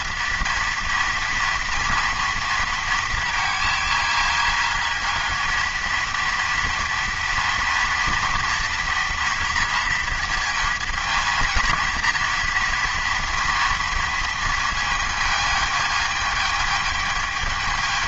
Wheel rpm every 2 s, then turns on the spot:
230, 230, 220, 230, 240, 230, 230, 230, 220.
none